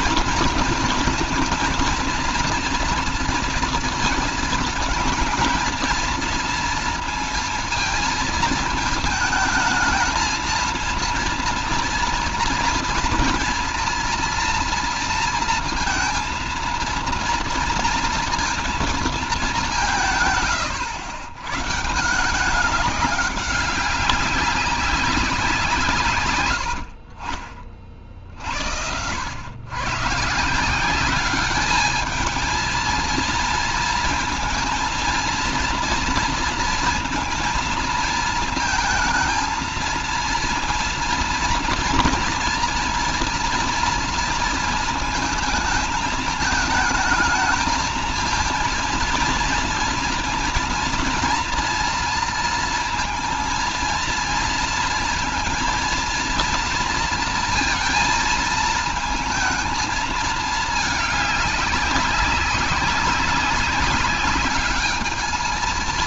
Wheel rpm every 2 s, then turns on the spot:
230, 230, 220, 230, 220, 230, 230, 230, 230, 230, 120, 190, 200, 90, 60, 170, 230, 230, 230, 220, 230, 230, 230, 220, 230, 230, 230, 230, 230, 230, 210, 200, 210.
26-28